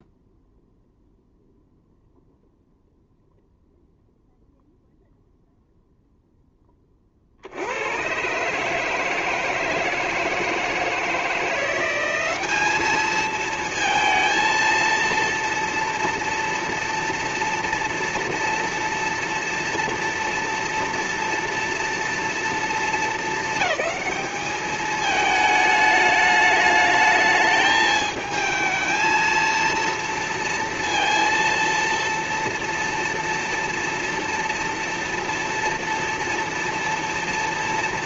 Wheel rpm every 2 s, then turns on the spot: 0, 0, 0, 0, 130, 160, 190, 230, 240, 230, 230, 230, 210, 210, 220, 230, 230, 230, 230.
none